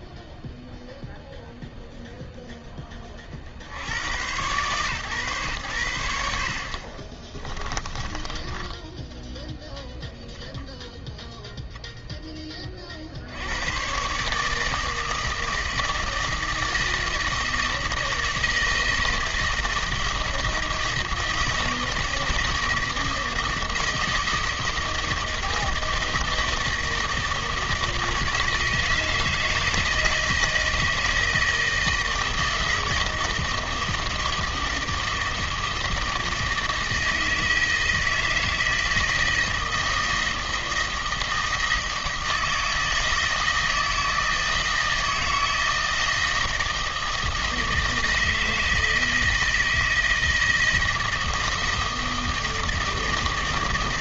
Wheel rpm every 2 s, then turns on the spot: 0, 100, 100, 20, 0, 0, 120, 160, 160, 160, 160, 160, 160, 160, 160, 160, 160, 160, 160, 160, 160, 160, 160, 160, 160, 160, 160.
6-8